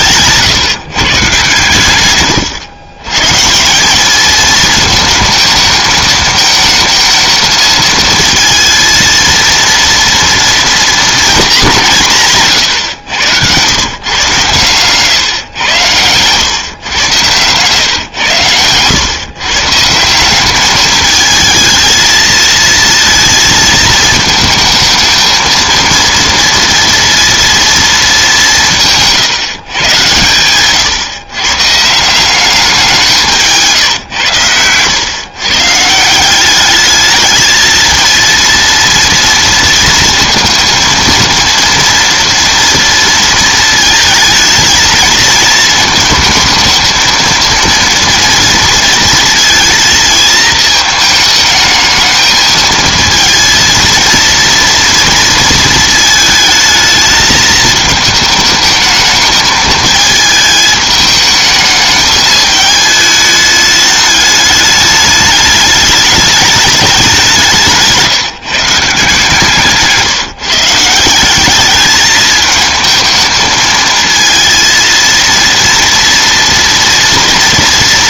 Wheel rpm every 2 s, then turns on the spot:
160, 120, 220, 220, 220, 230, 140, 130, 120, 110, 200, 230, 220, 230, 170, 120, 190, 110, 200, 230, 230, 230, 220, 220, 230, 220, 220, 230, 220, 220, 220, 220, 210, 210, 160, 150, 220, 230, 240.
28-30